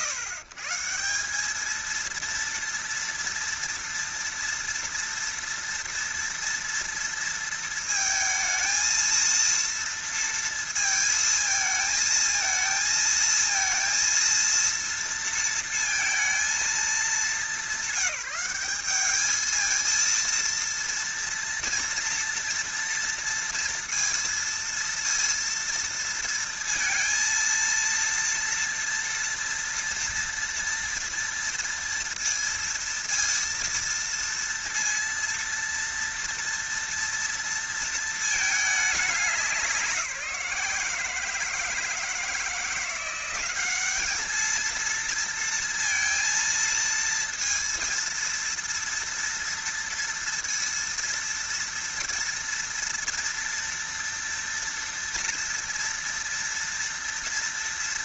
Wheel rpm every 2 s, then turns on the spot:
150, 230, 230, 230, 230, 230, 220, 230, 230, 200, 230, 230, 230, 230, 230, 230, 230, 230, 230, 220, 170, 170, 220, 230, 230, 230, 230, 230, 230.
none